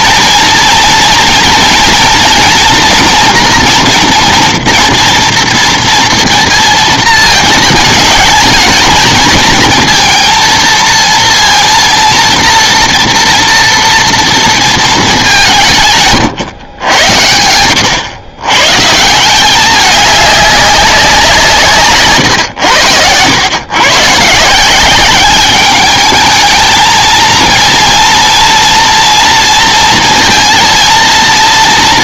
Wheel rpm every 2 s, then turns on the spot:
230, 230, 240, 230, 220, 230, 240, 230, 120, 120, 200, 110, 160, 220, 230, 230.
none